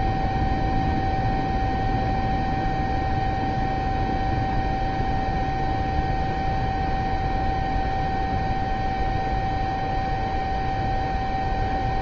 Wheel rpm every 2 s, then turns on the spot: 0, 0, 0, 0, 0, 0.
none